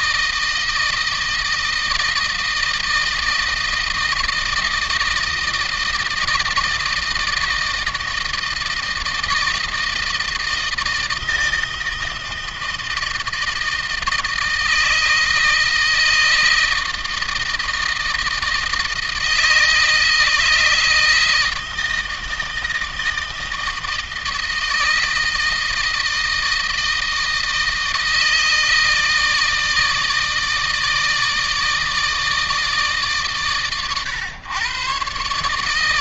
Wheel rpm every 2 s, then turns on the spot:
160, 160, 160, 160, 160, 160, 160, 160, 160, 160, 160, 160, 160, 160, 160, 160, 150, 130.
none